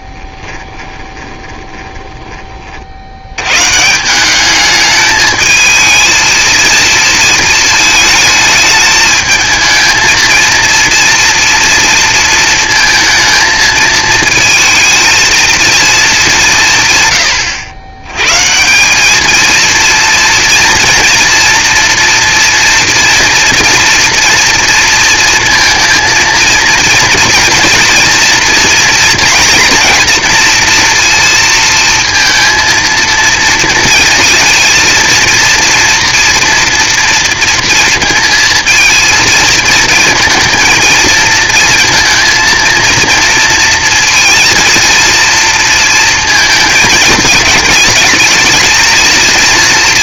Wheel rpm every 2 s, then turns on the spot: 10, 30, 200, 230, 210, 230, 230, 220, 170, 160, 230, 230, 230, 230, 230, 230, 230, 230, 230, 230, 230, 230, 230, 220, 220.
0-2